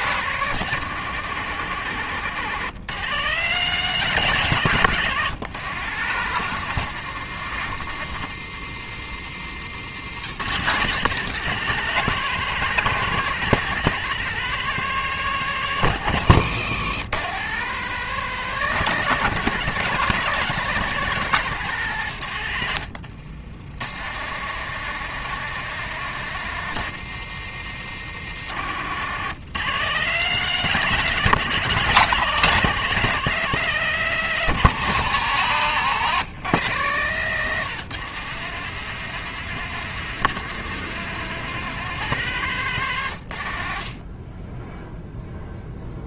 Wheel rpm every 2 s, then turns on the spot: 140, 150, 150, 150, 120, 150, 170, 170, 120, 160, 160, 80, 160, 140, 120, 160, 160, 110, 140, 160, 170, 120, 0.
22-24